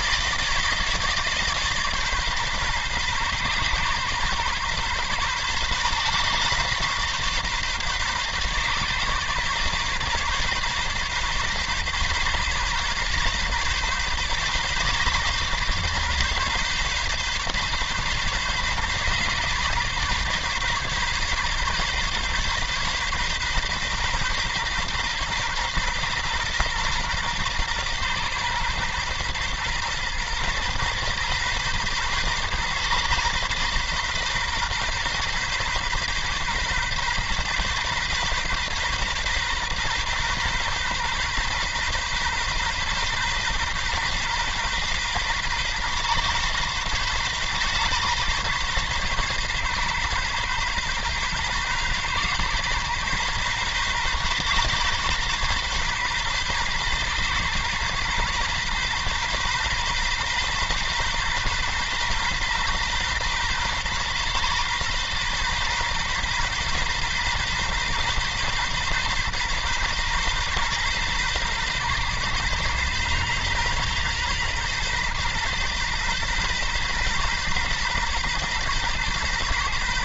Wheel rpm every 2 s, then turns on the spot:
160, 140, 130, 130, 130, 130, 140, 130, 140, 130, 140, 130, 130, 130, 120, 120, 130, 130, 130, 130, 130, 130, 130, 130, 130, 130, 130, 130, 130, 130, 130, 130, 130, 130, 130, 130, 130, 130, 130, 130.
none